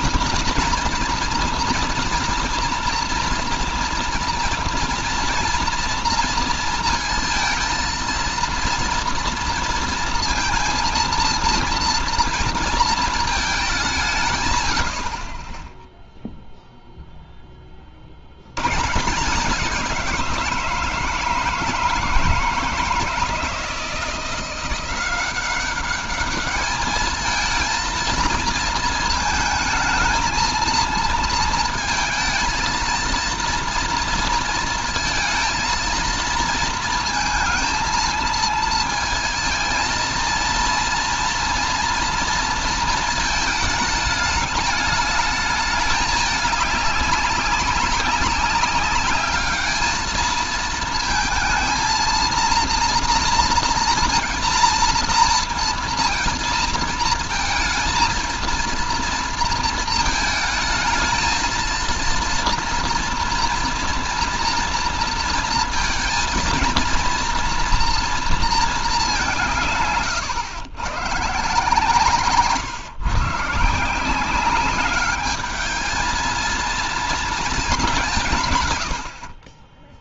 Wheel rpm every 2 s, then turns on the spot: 230, 230, 230, 230, 230, 230, 220, 50, 0, 130, 160, 160, 180, 210, 230, 230, 230, 230, 230, 230, 230, 230, 210, 200, 200, 220, 230, 230, 230, 230, 220, 230, 230, 230, 220, 120, 150, 200, 230, 110.
none